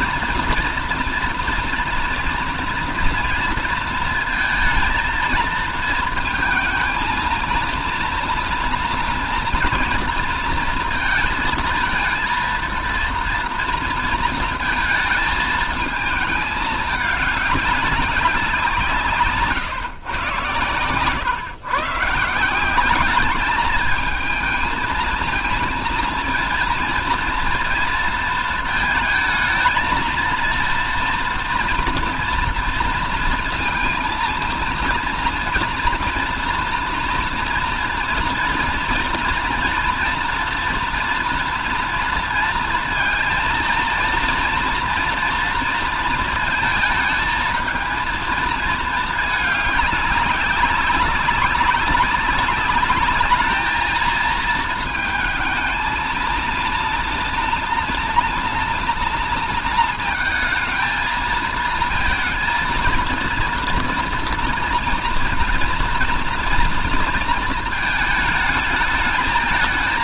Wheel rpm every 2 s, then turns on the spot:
230, 240, 230, 220, 230, 230, 230, 230, 210, 170, 110, 180, 220, 230, 230, 230, 230, 230, 230, 230, 230, 230, 230, 230, 220, 190, 200, 230, 230, 230, 220, 230, 230, 230, 220.
none